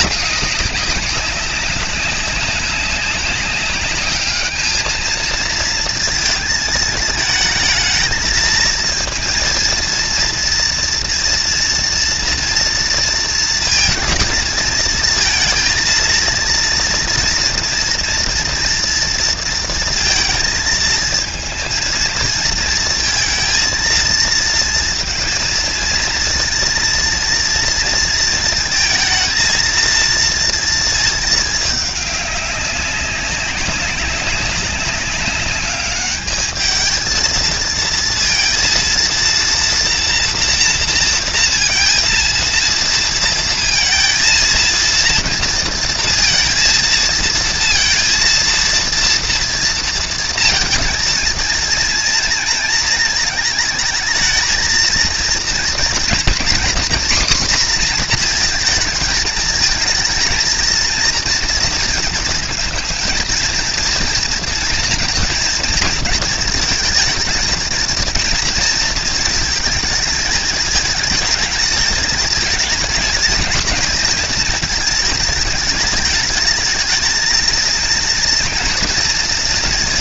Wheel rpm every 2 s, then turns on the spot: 190, 200, 220, 220, 230, 230, 230, 220, 230, 230, 220, 230, 230, 230, 230, 220, 190, 200, 220, 230, 230, 230, 230, 230, 230, 220, 220, 230, 250, 220, 230, 230, 230, 230, 230, 220, 220, 220, 220, 230.
none